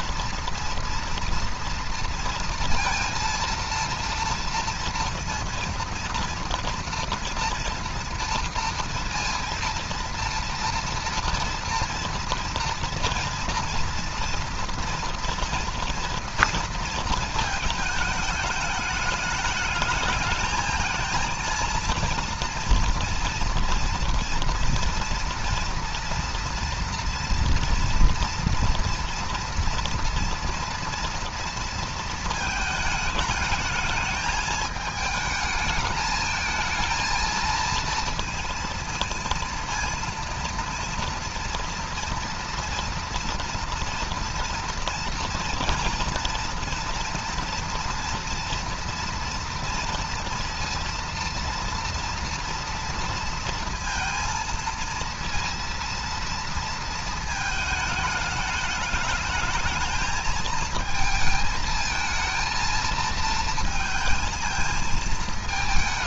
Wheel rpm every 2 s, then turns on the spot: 230, 230, 230, 230, 230, 230, 230, 230, 230, 210, 220, 230, 230, 230, 230, 230, 220, 210, 220, 230, 230, 230, 230, 230, 230, 230, 230, 230, 230, 210, 220, 220, 220.
none